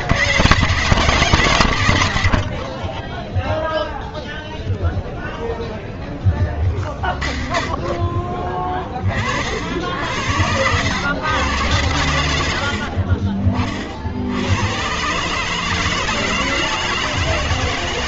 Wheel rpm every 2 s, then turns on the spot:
70, 110, 0, 10, 20, 80, 70, 90, 160.
none